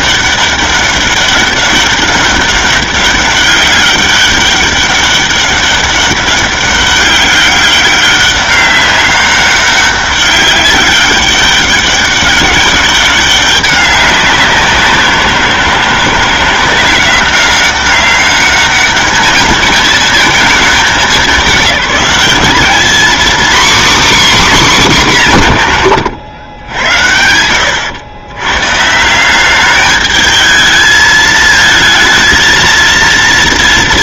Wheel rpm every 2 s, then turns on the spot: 200, 200, 200, 200, 200, 200, 200, 190, 180, 210, 220, 220, 260, 100, 130, 210, 230.
none